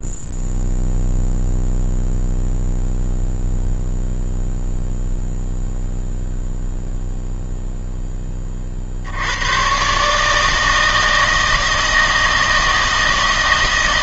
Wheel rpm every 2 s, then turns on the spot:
0, 0, 0, 0, 40, 160, 160.
none